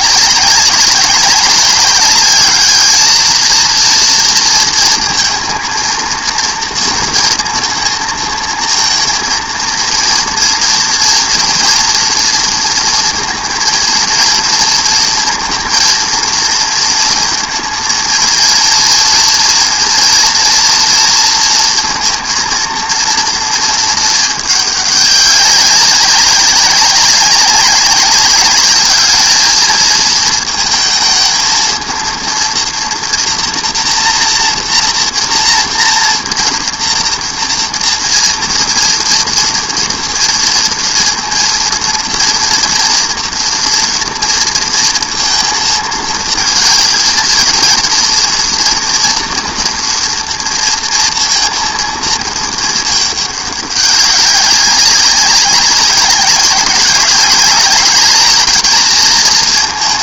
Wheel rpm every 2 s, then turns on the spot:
190, 210, 230, 230, 230, 230, 230, 230, 230, 230, 240, 230, 210, 200, 210, 220, 230, 240, 230, 230, 230, 230, 230, 230, 230, 240, 220, 190, 200, 220.
none